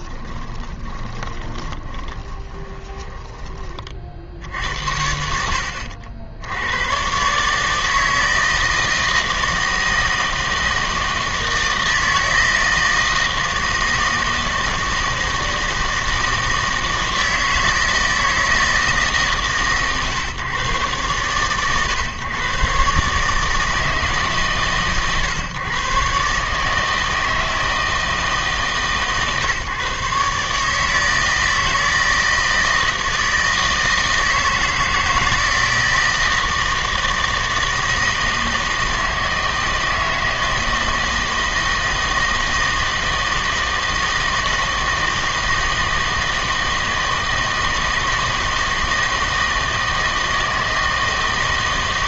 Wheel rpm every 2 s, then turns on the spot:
20, 20, 60, 90, 160, 160, 160, 160, 160, 160, 120, 130, 140, 150, 150, 150, 160, 160, 160, 160, 160, 160, 160, 160, 160, 160.
0-4